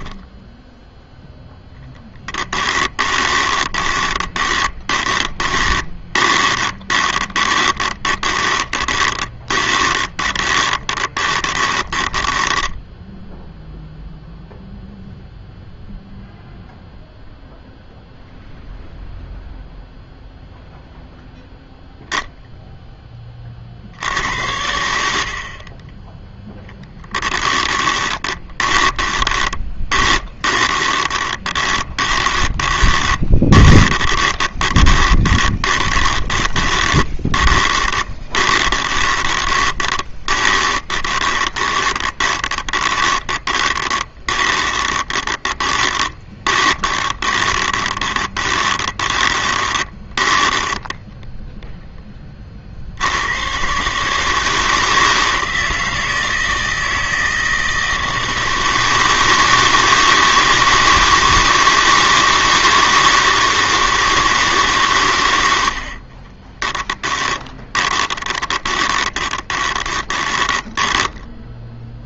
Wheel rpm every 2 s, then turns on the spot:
0, 20, 20, 20, 20, 20, 10, 0, 0, 0, 0, 10, 80, 10, 20, 20, 20, 20, 20, 20, 30, 20, 20, 20, 20, 10, 70, 160, 160, 160, 160, 160, 130, 10, 20, 10.
2-12 26-52 66-72